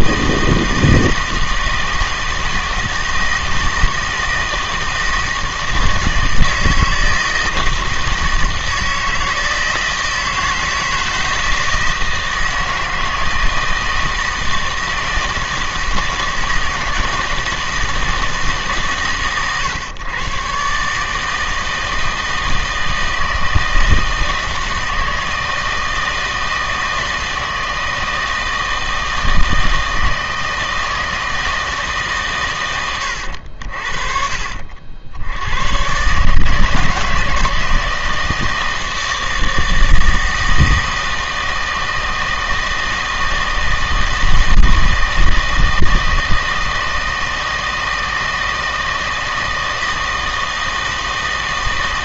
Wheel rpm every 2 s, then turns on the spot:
160, 160, 160, 160, 160, 160, 160, 160, 160, 150, 140, 160, 160, 160, 160, 160, 100, 70, 160, 160, 160, 160, 160, 160, 160, 160.
none